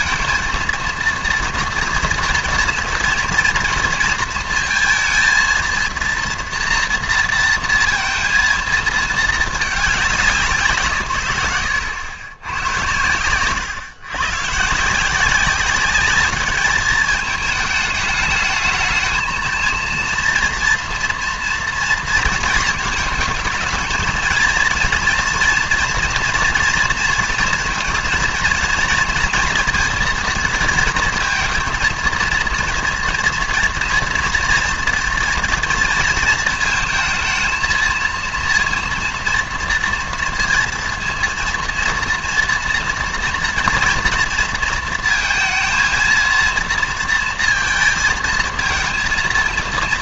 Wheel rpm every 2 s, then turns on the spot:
230, 230, 230, 240, 230, 160, 110, 140, 210, 220, 230, 220, 230, 230, 230, 230, 230, 240, 230, 230, 230, 230, 230, 230, 230.
none